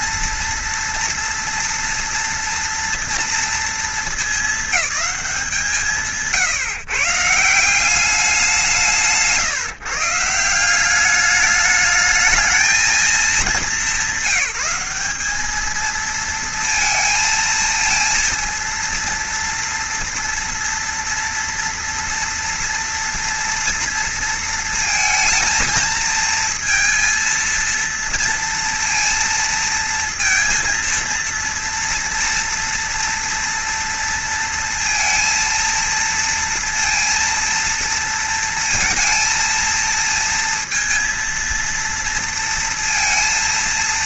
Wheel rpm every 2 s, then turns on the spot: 230, 230, 200, 150, 170, 200, 220, 190, 230, 230, 230, 230, 230, 230, 230, 230, 240, 230, 230, 230, 230, 230.
none